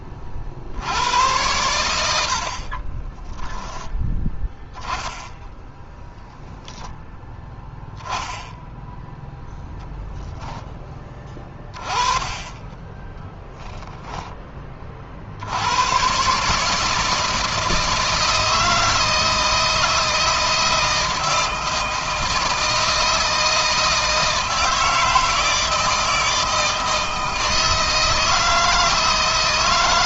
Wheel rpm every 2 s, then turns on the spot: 80, 40, 10, 0, 0, 20, 10, 40, 160, 160, 170, 160, 160, 160, 170.
2-4